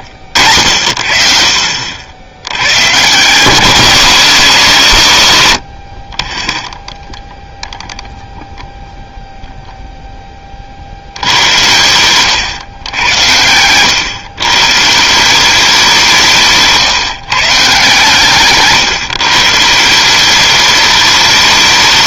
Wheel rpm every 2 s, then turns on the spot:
60, 110, 150, 0, 0, 50, 100, 140, 160, 140, 200.
none